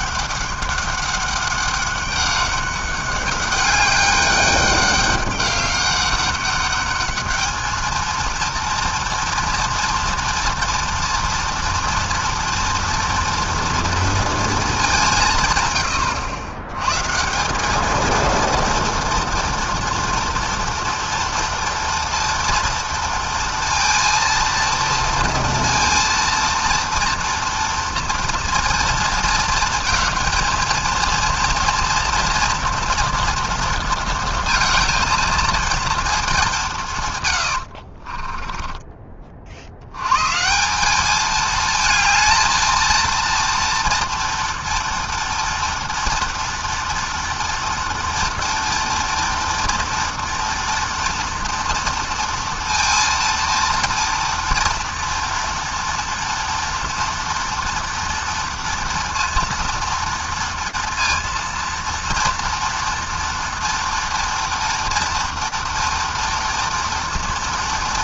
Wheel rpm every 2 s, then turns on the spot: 200, 200, 200, 200, 230, 230, 230, 220, 100, 230, 230, 230, 230, 230, 230, 230, 240, 230, 190, 30, 150, 230, 230, 230, 230, 230, 230, 230, 230, 230, 230, 230, 230, 230.
38-40